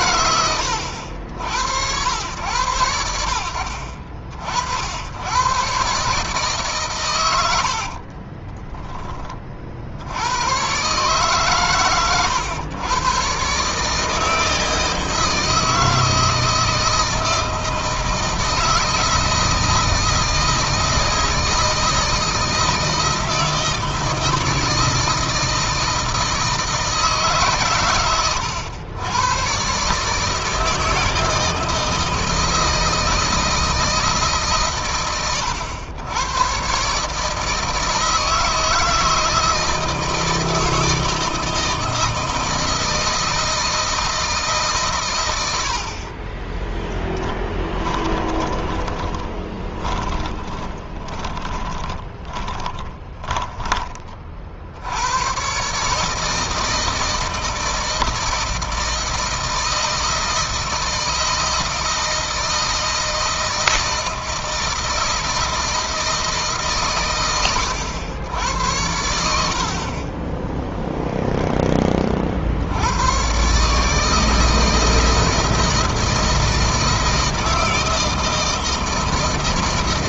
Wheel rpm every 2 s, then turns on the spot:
100, 90, 60, 140, 20, 120, 100, 160, 160, 160, 160, 160, 160, 160, 90, 160, 160, 130, 120, 160, 160, 160, 150, 20, 20, 20, 30, 60, 160, 160, 160, 160, 160, 150, 90, 10, 70, 160, 160, 160.
8-10 46-54 70-72